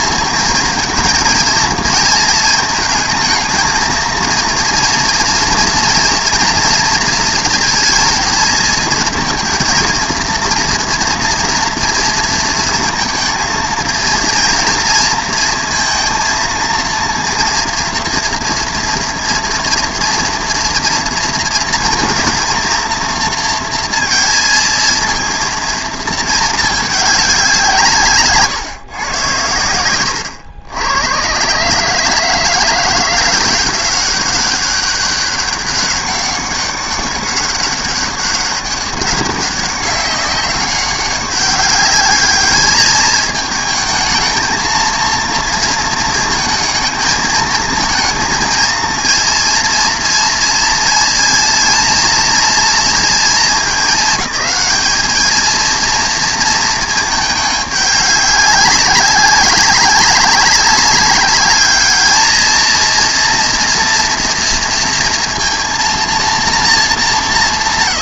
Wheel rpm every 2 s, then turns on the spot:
220, 230, 230, 230, 220, 230, 230, 230, 230, 230, 230, 230, 230, 220, 140, 110, 170, 200, 200, 200, 190, 210, 220, 220, 230, 230, 230, 200, 230, 200, 200, 220, 230, 230.
none